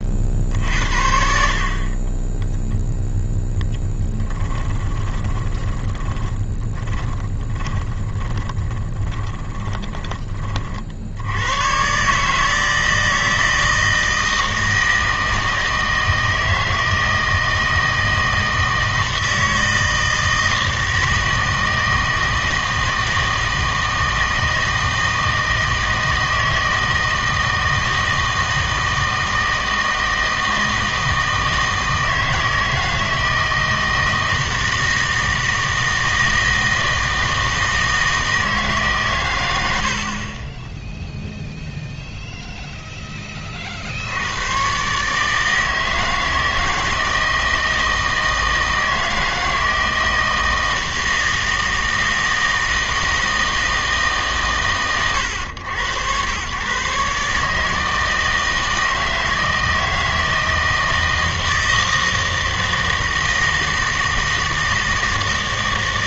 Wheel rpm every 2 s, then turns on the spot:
50, 0, 10, 10, 20, 30, 160, 160, 160, 160, 160, 160, 160, 160, 160, 160, 160, 160, 160, 150, 10, 0, 120, 160, 160, 160, 160, 120, 130, 160, 160, 160, 160.
4-10